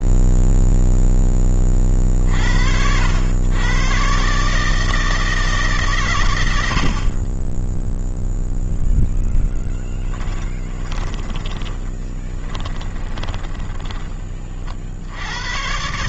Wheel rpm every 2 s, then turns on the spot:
0, 80, 150, 60, 0, 20, 20, 60.
10-14